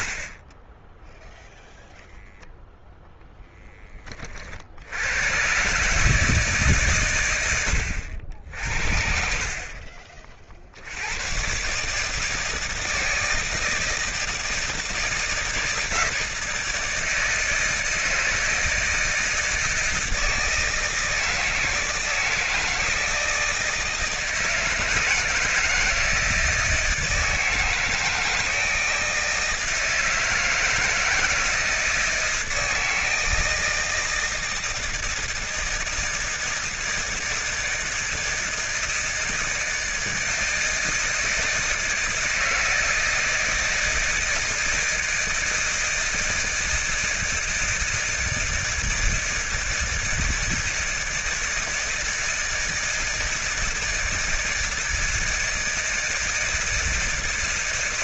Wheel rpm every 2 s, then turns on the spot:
0, 10, 110, 120, 50, 120, 160, 160, 160, 160, 160, 160, 170, 160, 160, 160, 160, 160, 160, 160, 160, 160, 160, 160, 160, 160, 160, 160, 160.
none